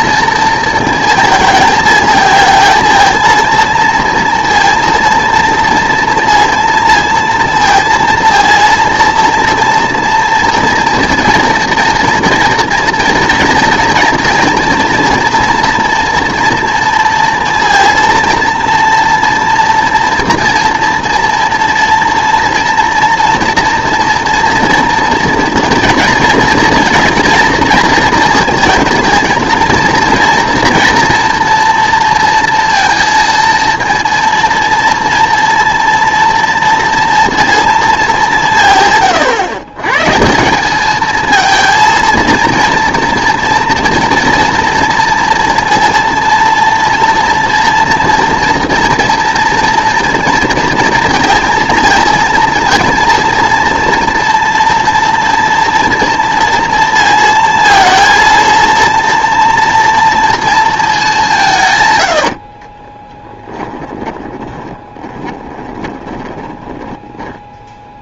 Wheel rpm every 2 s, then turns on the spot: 230, 230, 230, 230, 230, 230, 230, 230, 230, 230, 230, 230, 230, 230, 220, 230, 230, 230, 230, 160, 190, 230, 230, 230, 240, 230, 230, 230, 230, 230, 230, 40, 10, 30.
62-68